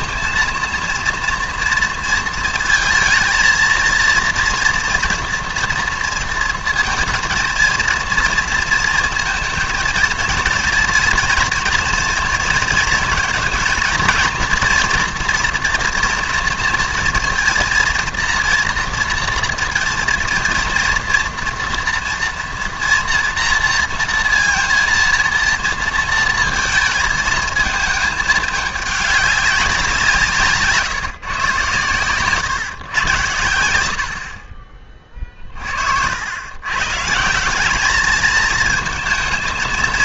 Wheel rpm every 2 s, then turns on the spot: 230, 230, 230, 220, 230, 230, 230, 240, 230, 230, 230, 230, 230, 220, 210, 160, 130, 40, 110, 220.
none